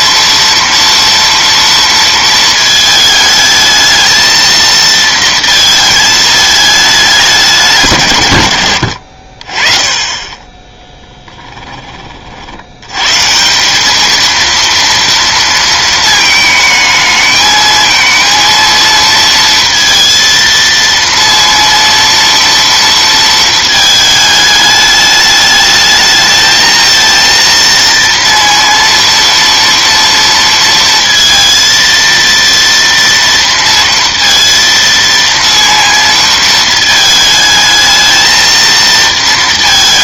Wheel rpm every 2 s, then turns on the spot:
240, 220, 230, 210, 100, 10, 80, 230, 220, 230, 230, 230, 210, 220, 230, 230, 230, 230, 230, 220.
none